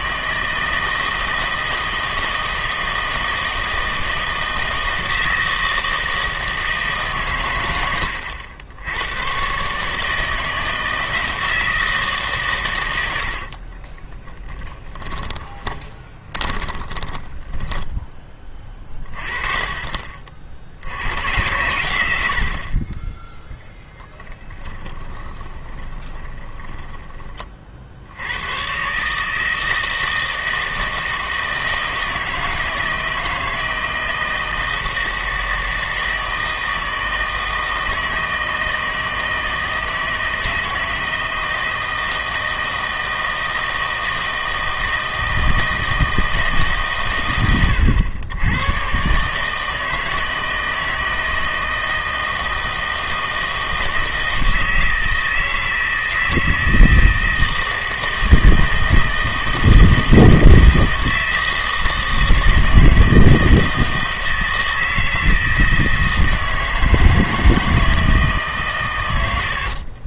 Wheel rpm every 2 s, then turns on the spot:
160, 160, 160, 160, 90, 160, 120, 20, 20, 30, 60, 60, 20, 20, 120, 160, 160, 160, 160, 160, 160, 160, 160, 150, 110, 160, 160, 160, 160, 160, 160, 160, 160, 160, 140.
14-18 24-28